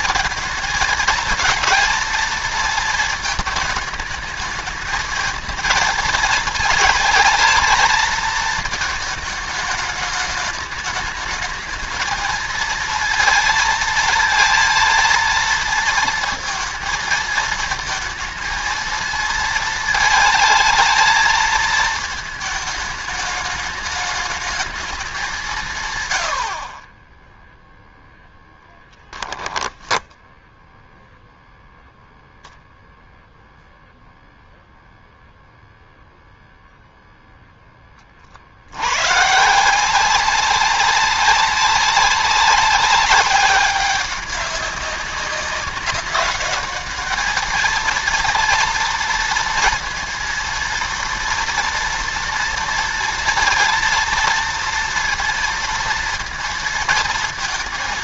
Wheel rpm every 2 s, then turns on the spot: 220, 230, 220, 230, 220, 210, 220, 230, 220, 220, 220, 220, 200, 10, 10, 0, 0, 0, 0, 60, 190, 200, 200, 210, 230, 230, 230, 230, 230.
28-30